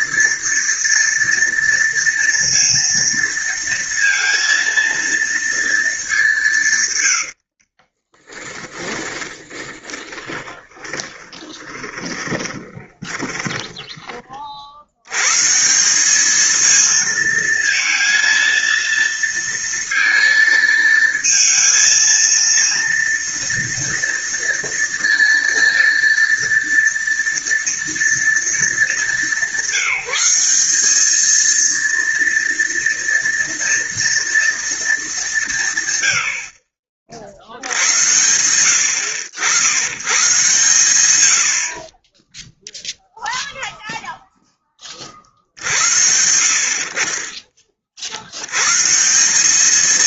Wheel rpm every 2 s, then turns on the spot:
230, 230, 230, 160, 20, 20, 20, 60, 220, 230, 230, 230, 230, 230, 220, 200, 230, 230, 60, 90, 130, 0, 20, 50, 120.
8-14